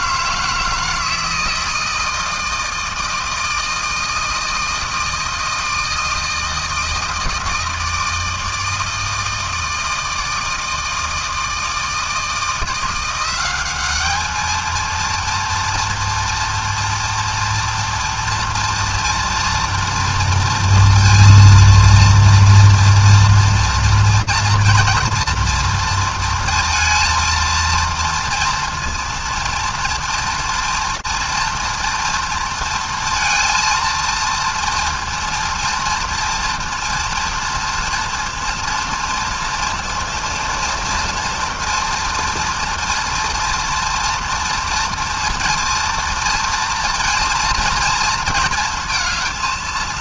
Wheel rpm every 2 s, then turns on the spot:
160, 160, 160, 160, 160, 160, 160, 220, 240, 230, 230, 230, 240, 230, 230, 240, 230, 230, 230, 230, 230, 230, 230, 230, 220.
none